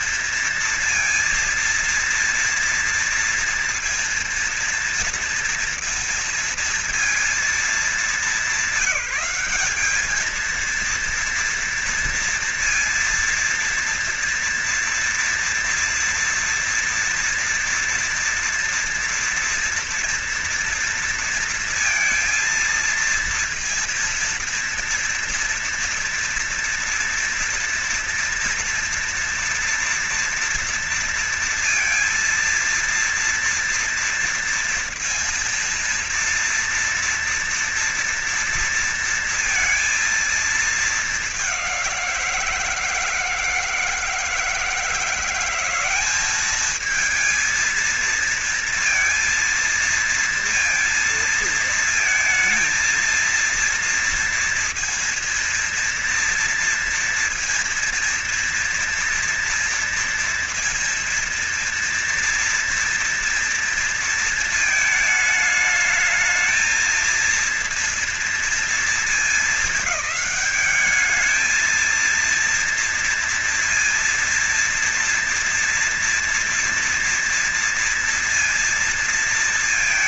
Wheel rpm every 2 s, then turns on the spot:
230, 230, 230, 230, 200, 210, 230, 230, 230, 230, 230, 230, 230, 230, 240, 230, 230, 230, 230, 230, 220, 170, 160, 200, 230, 230, 230, 230, 230, 240, 230, 230, 230, 220, 230, 210, 230, 230, 230, 230.
none